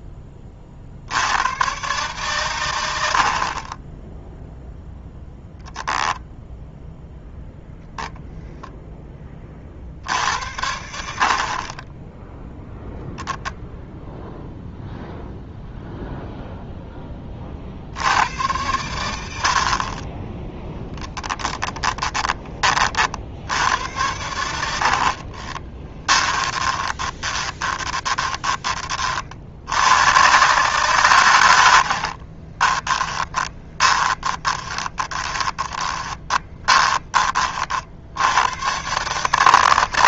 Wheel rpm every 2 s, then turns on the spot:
60, 80, 0, 0, 10, 70, 0, 0, 10, 90, 10, 40, 60, 20, 30, 130, 20, 20, 20, 140.
20-22 24-28 32-38